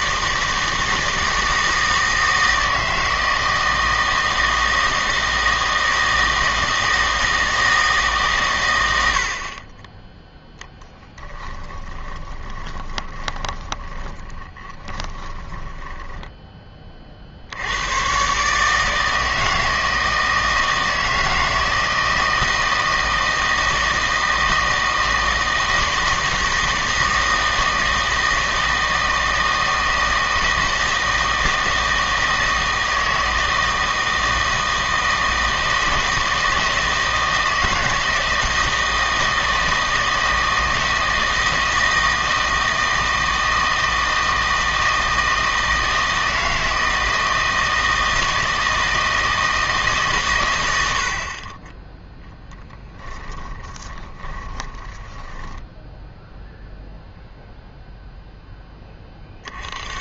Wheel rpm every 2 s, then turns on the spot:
160, 160, 160, 160, 100, 10, 20, 10, 30, 150, 160, 160, 160, 160, 160, 160, 160, 160, 160, 160, 160, 160, 160, 160, 160, 90, 10, 20, 0, 10.
10-16 52-56